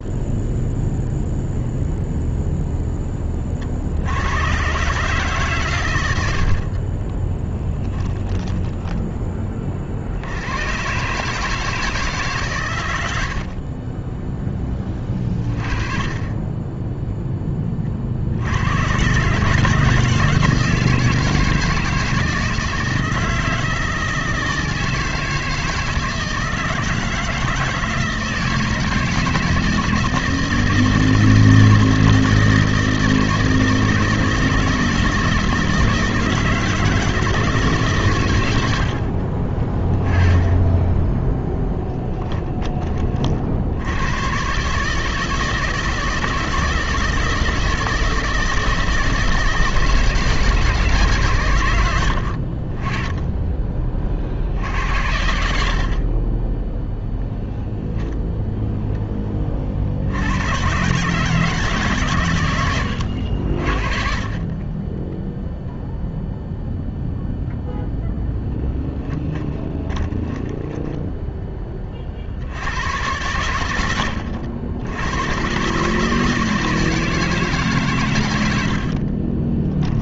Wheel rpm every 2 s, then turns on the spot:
0, 0, 120, 60, 10, 100, 120, 10, 10, 80, 160, 160, 160, 160, 160, 160, 160, 160, 160, 110, 20, 10, 130, 160, 160, 160, 50, 60, 20, 0, 110, 110, 30, 0, 0, 10, 80, 90, 160, 90.
6-10 70-72